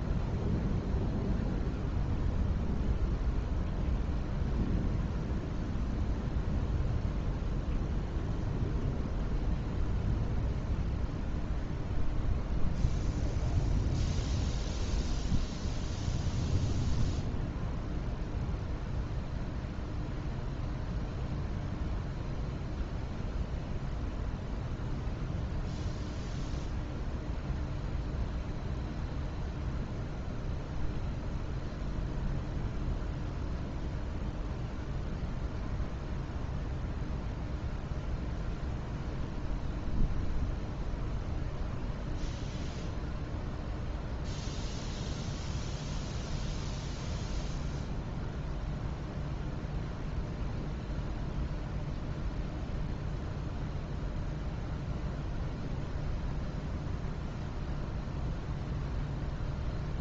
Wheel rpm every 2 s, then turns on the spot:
0, 0, 0, 0, 0, 0, 0, 0, 0, 0, 0, 0, 0, 0, 0, 0, 0, 0, 0, 0, 0, 0, 0, 0, 0, 0, 0, 0, 0, 0.
none